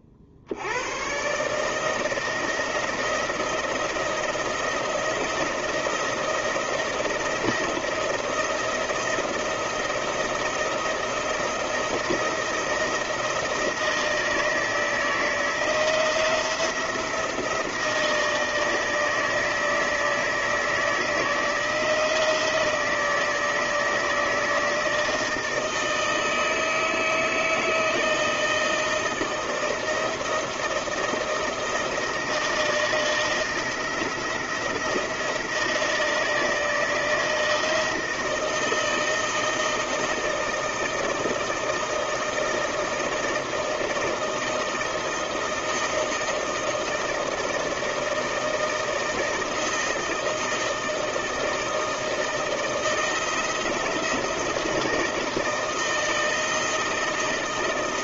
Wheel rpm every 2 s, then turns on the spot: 60, 170, 170, 170, 170, 170, 170, 160, 170, 160, 160, 160, 160, 160, 160, 160, 160, 170, 160, 160, 160, 160, 160, 160, 160, 160, 160, 160, 160.
none